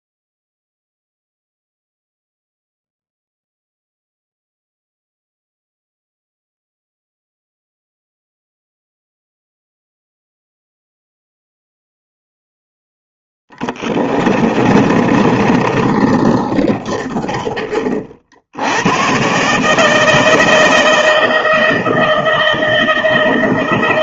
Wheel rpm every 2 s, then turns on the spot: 0, 0, 0, 0, 0, 0, 0, 30, 20, 100, 160, 160.
14-18